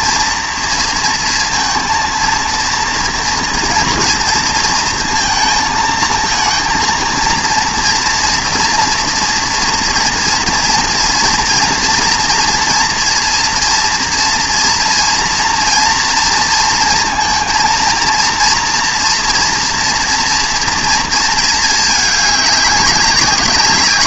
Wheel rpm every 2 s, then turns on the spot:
230, 230, 230, 230, 230, 230, 230, 230, 230, 230, 230, 210.
none